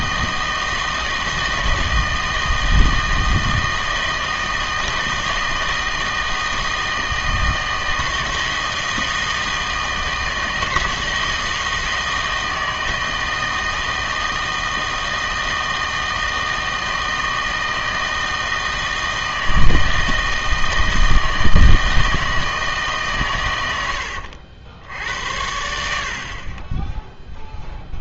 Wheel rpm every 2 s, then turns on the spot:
160, 160, 160, 160, 160, 160, 160, 160, 160, 160, 160, 150, 80, 30.
26-28